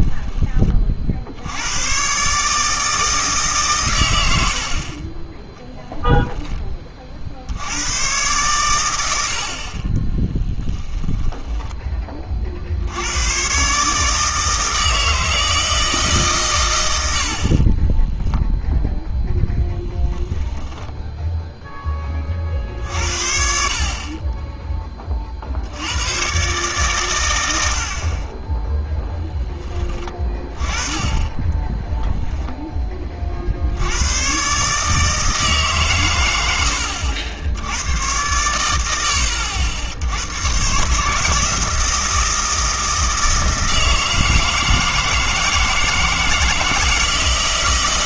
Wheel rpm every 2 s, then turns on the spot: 30, 150, 60, 20, 110, 10, 70, 160, 110, 0, 10, 60, 10, 120, 10, 20, 20, 140, 90, 100, 130, 160, 160, 160.
4-6 10-12 20-22